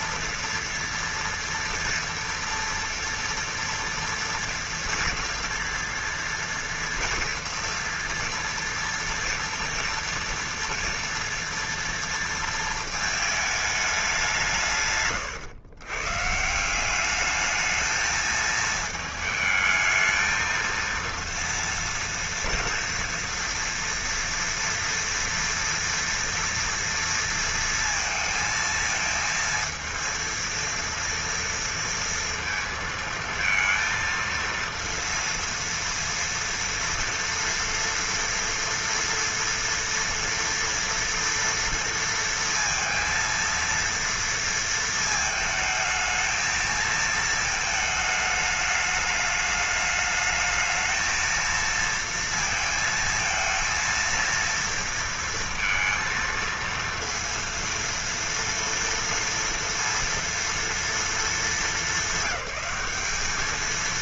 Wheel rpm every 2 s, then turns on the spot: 240, 230, 240, 240, 240, 230, 230, 170, 160, 220, 230, 230, 230, 230, 220, 230, 230, 230, 230, 230, 230, 230, 230, 220, 210, 220, 230, 230, 230, 230, 230, 200.
none